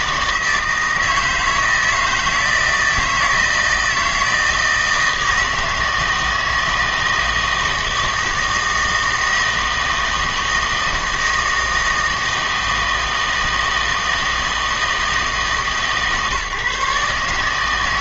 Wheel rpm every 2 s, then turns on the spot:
160, 160, 160, 160, 160, 160, 160, 160, 140.
none